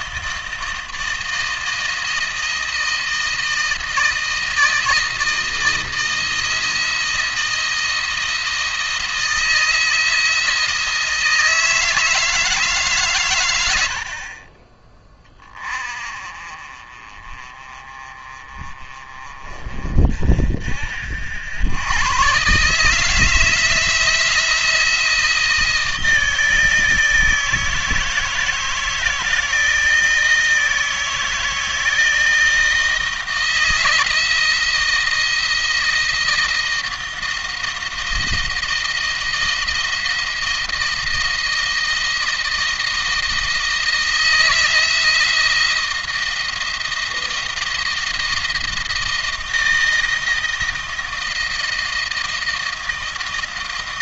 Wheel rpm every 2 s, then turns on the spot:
160, 160, 160, 160, 160, 160, 140, 30, 40, 30, 50, 150, 170, 160, 160, 160, 160, 170, 160, 170, 160, 160, 170, 170, 170, 160, 160.
none